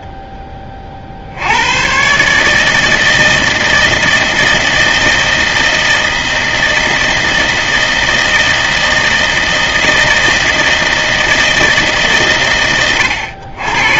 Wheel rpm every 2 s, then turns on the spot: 30, 140, 160, 160, 160, 160, 100.
none